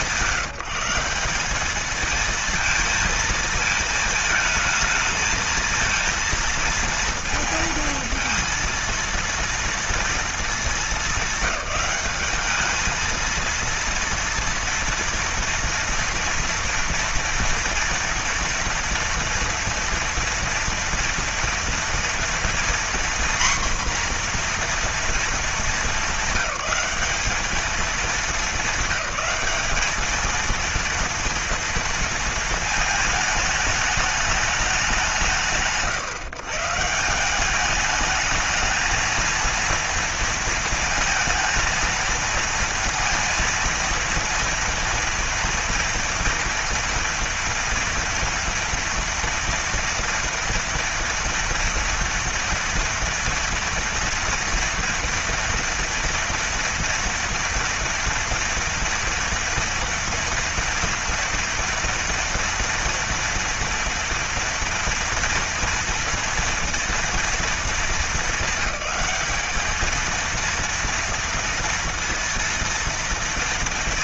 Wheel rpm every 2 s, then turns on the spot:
190, 230, 220, 230, 230, 200, 220, 230, 240, 230, 230, 240, 240, 200, 200, 230, 220, 170, 160, 220, 230, 230, 230, 230, 230, 230, 230, 240, 230, 230, 230, 240, 230, 230, 210, 230, 230.
none